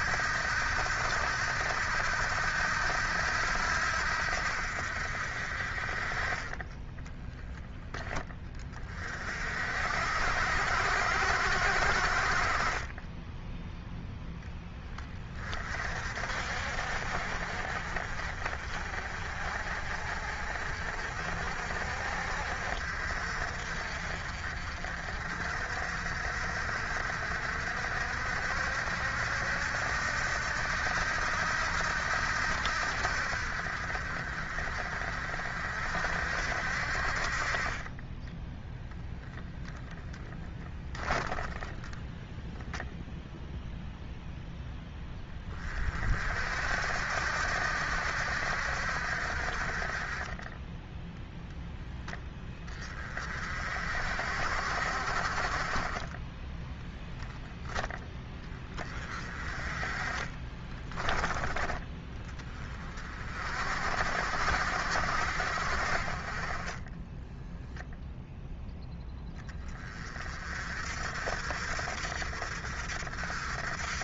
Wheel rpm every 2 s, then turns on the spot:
80, 80, 60, 20, 20, 70, 40, 10, 50, 40, 50, 60, 50, 60, 70, 80, 80, 50, 60, 10, 10, 0, 0, 60, 70, 20, 20, 50, 10, 30, 30, 20, 60, 20, 0, 40, 60.
6-8 40-42 60-62 66-68